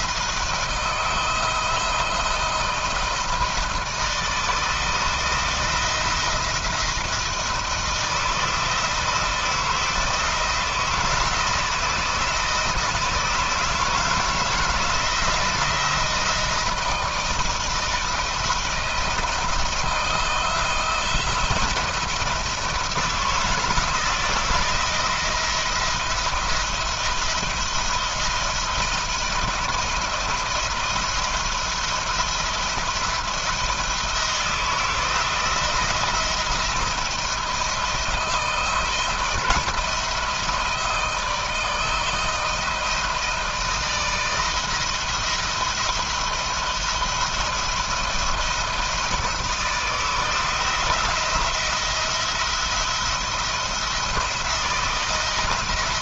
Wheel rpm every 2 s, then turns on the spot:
160, 160, 160, 170, 160, 160, 160, 170, 160, 170, 170, 160, 170, 170, 170, 160, 170, 160, 160, 160, 160, 160, 160, 170, 170, 170, 170, 170.
none